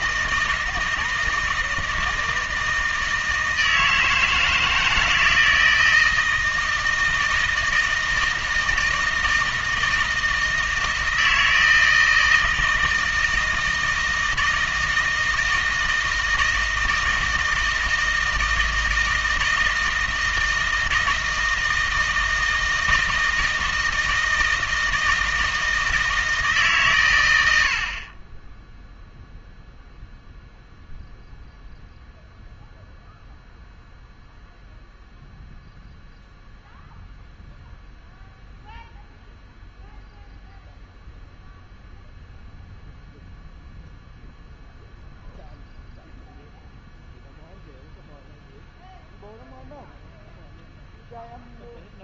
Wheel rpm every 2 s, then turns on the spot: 160, 160, 160, 160, 160, 160, 160, 160, 160, 160, 160, 160, 160, 130, 0, 0, 0, 0, 0, 0, 0, 0, 0, 0, 0, 0.
none